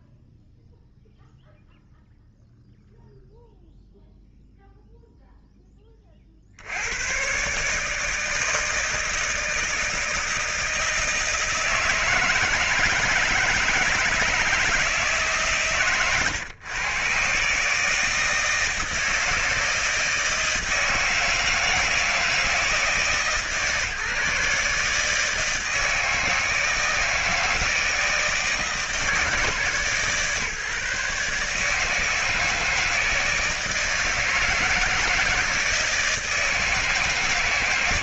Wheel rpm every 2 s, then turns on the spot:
0, 0, 0, 70, 160, 160, 160, 160, 120, 160, 160, 160, 150, 160, 160, 150, 160, 160, 160.
none